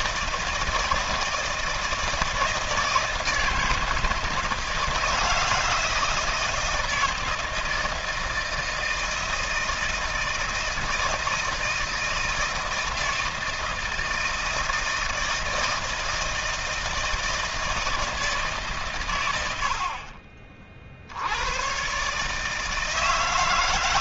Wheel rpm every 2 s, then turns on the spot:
160, 160, 160, 160, 160, 160, 160, 160, 160, 120, 70, 160.
none